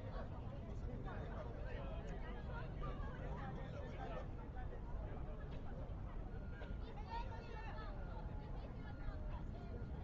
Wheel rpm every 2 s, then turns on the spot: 0, 0, 0, 0, 0.
none